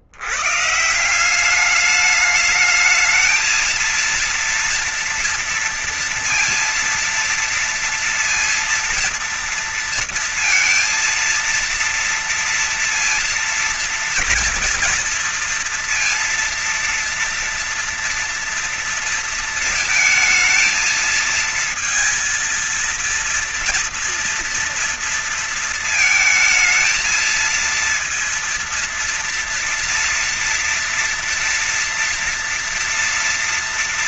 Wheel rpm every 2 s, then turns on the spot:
110, 210, 230, 230, 230, 230, 230, 230, 230, 230, 220, 230, 230, 230, 230, 230, 230.
none